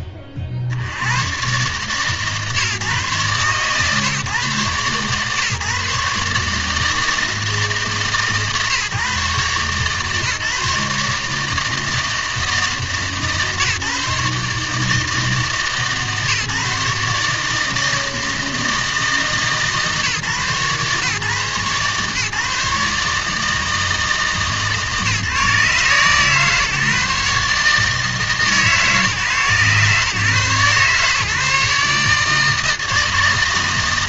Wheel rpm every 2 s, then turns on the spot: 40, 140, 130, 160, 140, 150, 160, 150, 150, 160, 120, 150, 150, 150, 140, 140, 160.
none